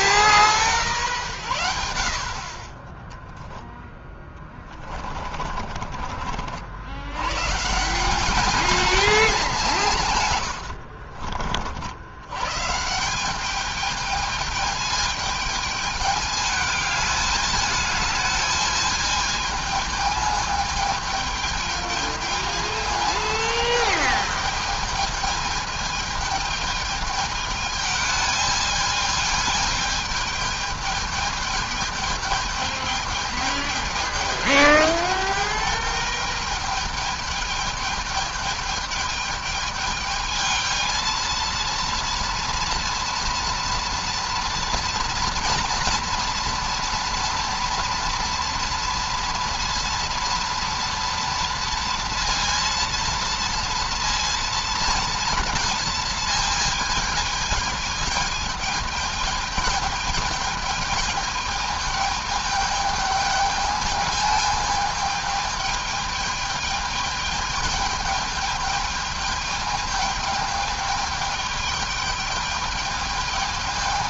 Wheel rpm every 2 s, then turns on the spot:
170, 20, 20, 80, 220, 90, 150, 220, 210, 220, 210, 220, 220, 220, 210, 210, 210, 210, 210, 210, 220, 230, 230, 230, 230, 240, 230, 230, 220, 210, 210, 210, 210, 210, 210, 210, 210.
4-6 10-12